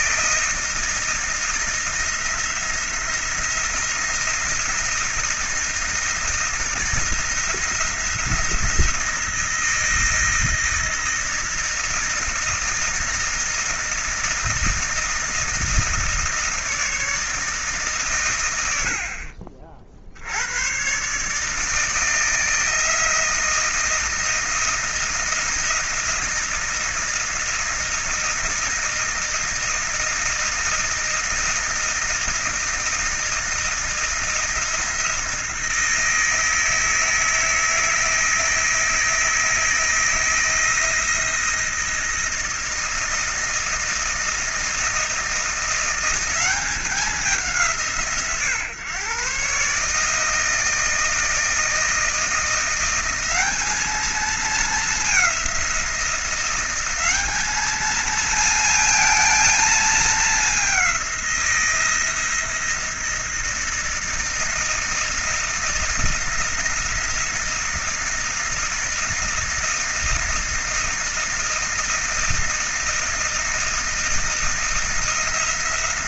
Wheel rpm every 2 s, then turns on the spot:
160, 170, 170, 160, 160, 160, 160, 160, 160, 70, 130, 160, 170, 160, 160, 160, 160, 160, 160, 160, 160, 160, 160, 190, 130, 160, 180, 210, 190, 230, 190, 170, 160, 160, 160, 160, 160, 160.
none